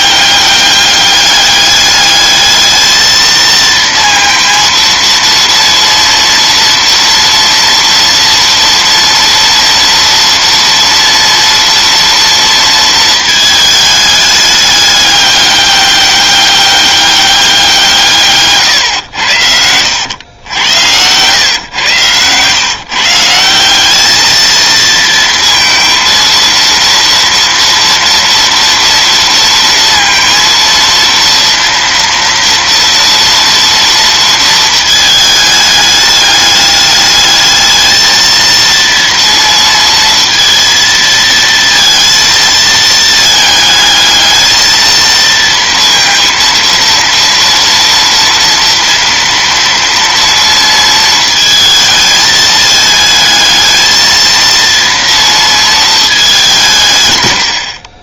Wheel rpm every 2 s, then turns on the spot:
200, 220, 230, 230, 230, 230, 220, 200, 200, 110, 120, 160, 230, 230, 230, 230, 230, 220, 210, 230, 230, 220, 230, 230, 230, 220, 220, 230, 110.
none